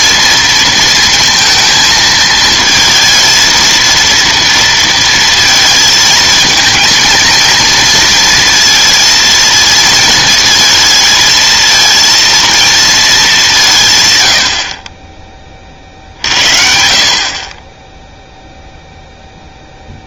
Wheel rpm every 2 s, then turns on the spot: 230, 220, 230, 230, 230, 220, 230, 60, 60, 0.
none